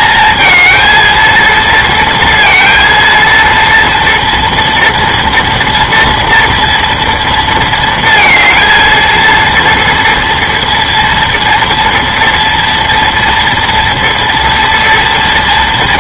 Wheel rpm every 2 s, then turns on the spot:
230, 230, 230, 230, 220, 230, 230, 230.
none